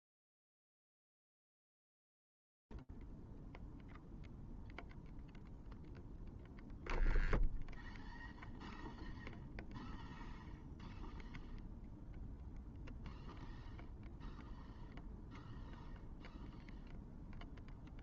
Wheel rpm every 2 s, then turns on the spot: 0, 0, 0, 0, 0, 0, 0, 0, 0.
none